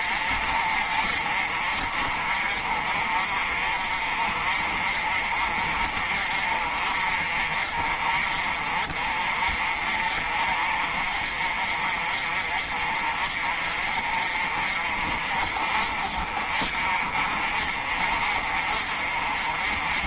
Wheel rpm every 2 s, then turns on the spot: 40, 40, 40, 40, 40, 40, 40, 40, 40, 40.
none